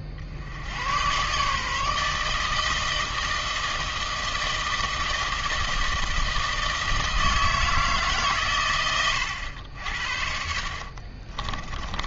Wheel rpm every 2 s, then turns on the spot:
40, 160, 160, 160, 130, 60.
10-12